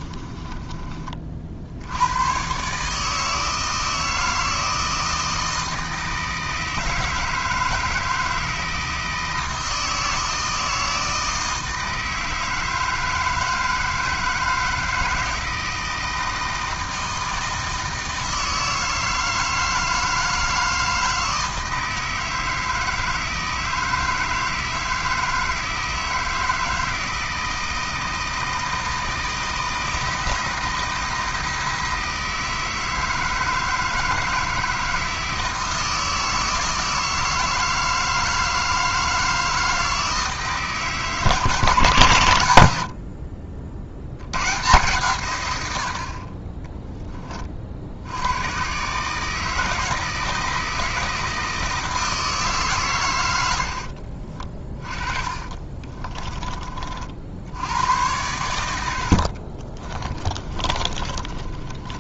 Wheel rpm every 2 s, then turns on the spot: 20, 150, 160, 160, 160, 160, 160, 160, 160, 160, 160, 160, 160, 160, 160, 170, 160, 160, 160, 160, 160, 70, 130, 10, 140, 160, 130, 30, 50, 90, 30.
42-44 54-56 60-62